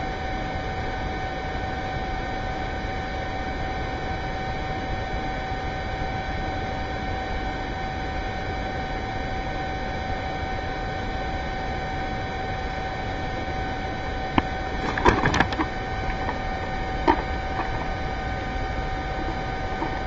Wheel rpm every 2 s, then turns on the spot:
0, 0, 0, 0, 0, 0, 0, 0, 0, 0.
none